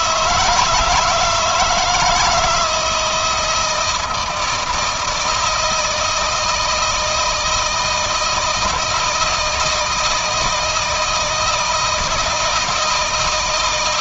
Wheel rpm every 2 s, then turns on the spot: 160, 160, 160, 170, 170, 160, 160.
none